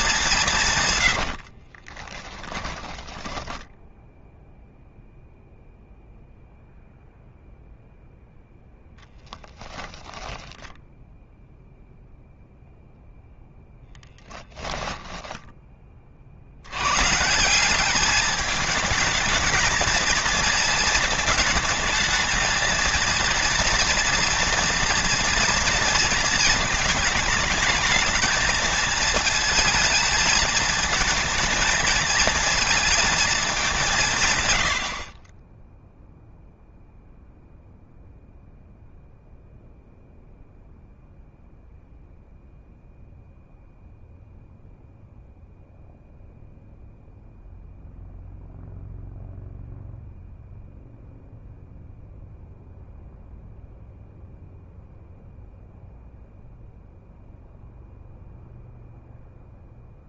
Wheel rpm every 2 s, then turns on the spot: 130, 10, 0, 0, 0, 0, 0, 10, 120, 220, 220, 230, 230, 220, 220, 220, 220, 50, 0, 0, 0, 0, 0, 0, 0, 0, 0, 0, 0, 0.
2-4 14-16